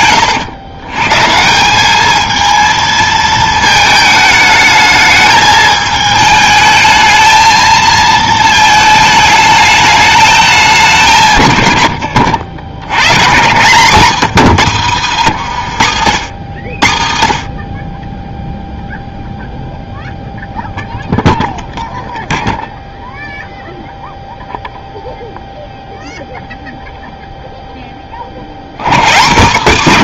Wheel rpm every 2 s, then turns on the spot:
120, 220, 220, 220, 220, 200, 90, 190, 100, 0, 0, 0, 0, 0, 90.
14-16